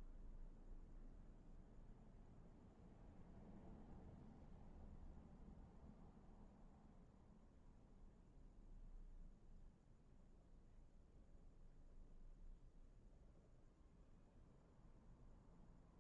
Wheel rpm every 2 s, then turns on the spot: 0, 0, 0, 0, 0, 0, 0, 0.
none